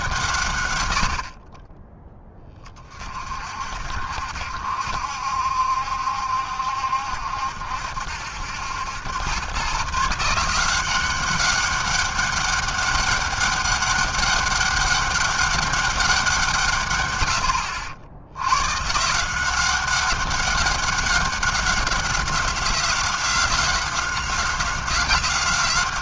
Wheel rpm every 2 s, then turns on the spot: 130, 20, 70, 70, 80, 170, 200, 200, 170, 100, 200, 190, 190.
none